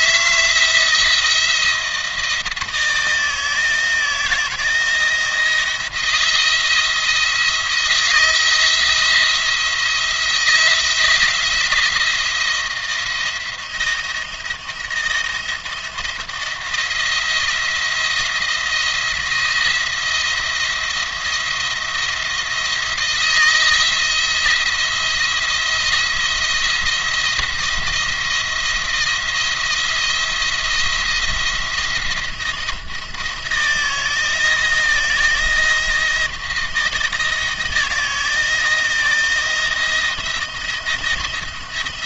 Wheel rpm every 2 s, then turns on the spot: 170, 160, 170, 170, 160, 170, 170, 160, 170, 170, 170, 170, 170, 170, 170, 170, 160, 170, 160, 160, 170.
none